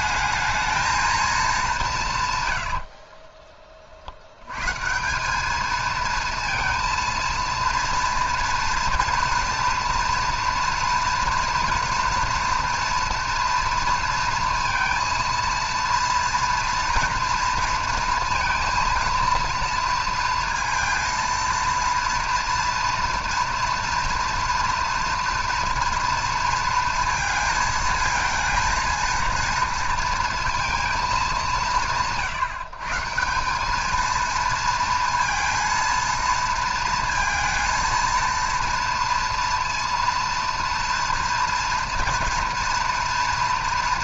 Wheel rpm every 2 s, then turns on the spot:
220, 100, 130, 230, 230, 230, 240, 230, 230, 230, 230, 230, 230, 230, 230, 230, 150, 230, 230, 230, 230, 240.
2-4